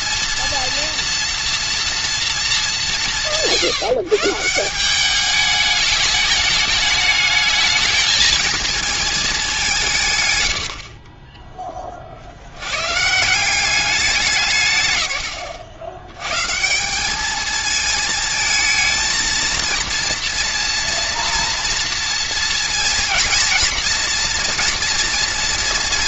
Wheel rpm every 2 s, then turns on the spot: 230, 200, 180, 210, 230, 90, 90, 150, 150, 220, 230, 230, 240.
none